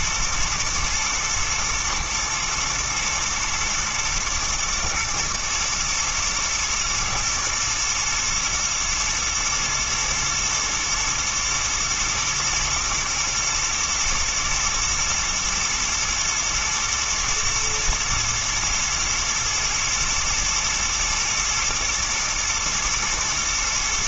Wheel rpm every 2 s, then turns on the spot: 120, 110, 110, 120, 110, 110, 110, 110, 120, 120, 110, 120.
none